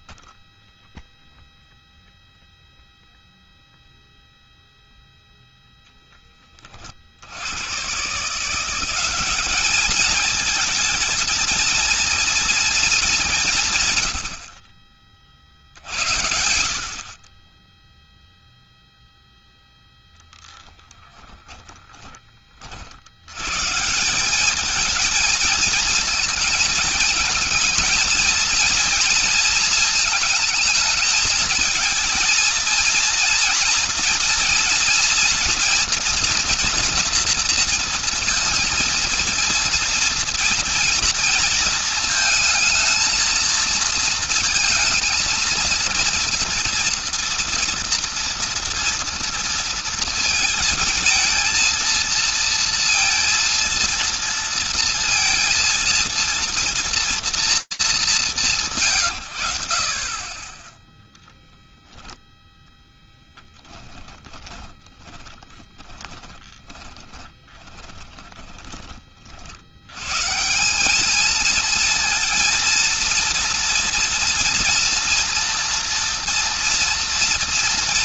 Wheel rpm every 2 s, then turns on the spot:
0, 0, 0, 30, 160, 220, 230, 60, 70, 0, 10, 30, 190, 220, 230, 220, 220, 230, 240, 230, 230, 220, 230, 230, 230, 230, 230, 230, 230, 160, 10, 0, 30, 20, 40, 190, 230, 230, 230.
20-22 64-68